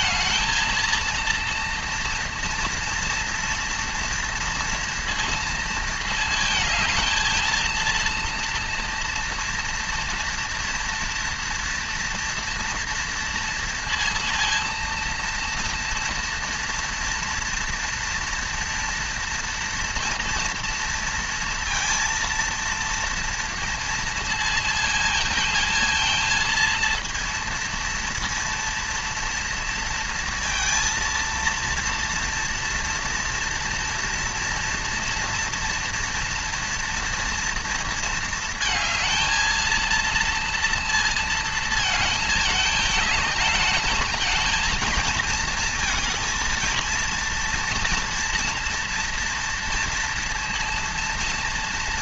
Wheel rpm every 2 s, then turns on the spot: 230, 230, 230, 220, 230, 230, 230, 230, 230, 230, 230, 230, 230, 230, 230, 230, 230, 230, 230, 230, 230, 210, 220, 230, 230, 230.
none